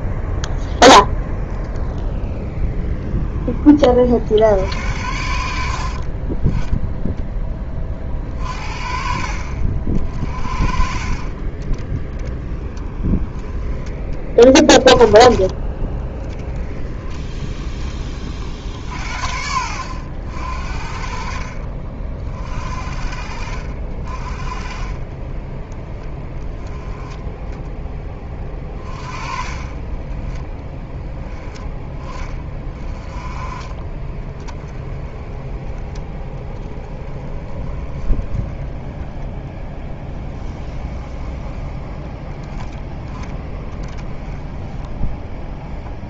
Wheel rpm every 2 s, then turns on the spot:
0, 10, 70, 20, 40, 50, 30, 20, 10, 40, 70, 40, 30, 10, 20, 10, 20, 20, 10, 10, 10, 10, 10.
12-14 40-42